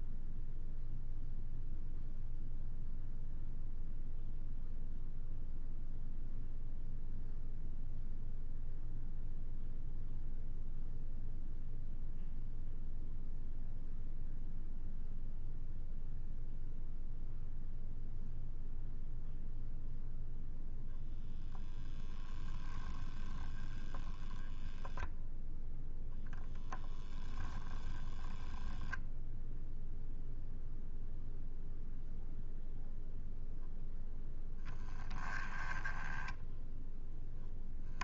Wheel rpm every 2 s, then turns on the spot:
0, 0, 0, 0, 0, 0, 0, 0, 0, 0, 0, 0, 0, 10, 0, 0, 0, 10, 0.
none